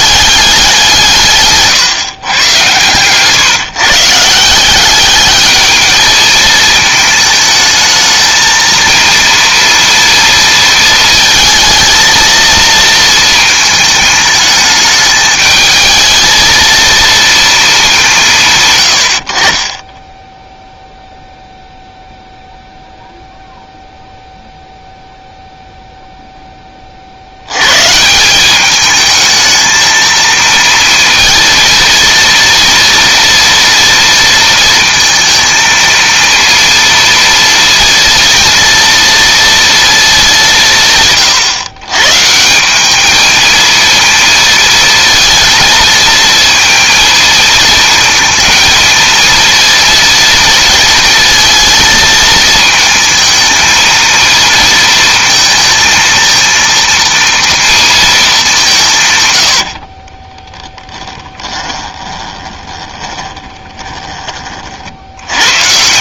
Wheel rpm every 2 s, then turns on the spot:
180, 130, 190, 220, 230, 220, 230, 210, 230, 130, 0, 0, 0, 20, 200, 230, 230, 230, 230, 230, 170, 190, 230, 230, 230, 230, 220, 230, 230, 170, 10, 20, 60.
60-64